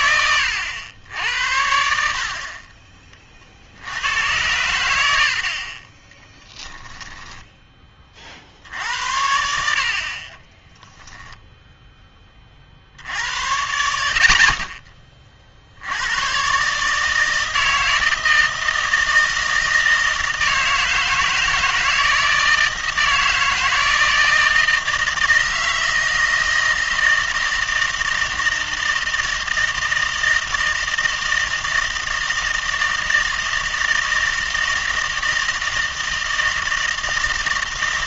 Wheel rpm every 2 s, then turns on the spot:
90, 30, 100, 0, 70, 10, 60, 30, 140, 160, 160, 160, 160, 160, 160, 160, 160, 160, 160.
10-12